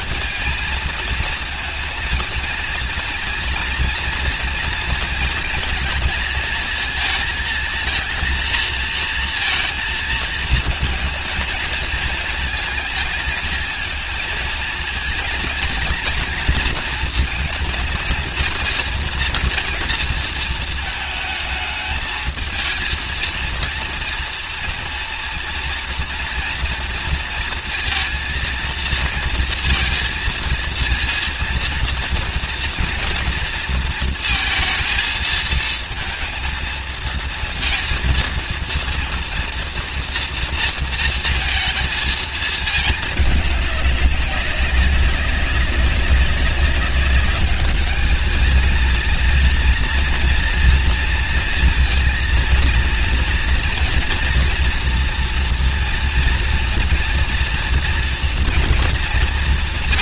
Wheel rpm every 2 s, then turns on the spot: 230, 220, 230, 220, 230, 220, 220, 220, 220, 220, 220, 230, 230, 230, 230, 230, 230, 230, 230, 230, 230, 220, 200, 200, 220, 230, 230, 230, 230, 240.
none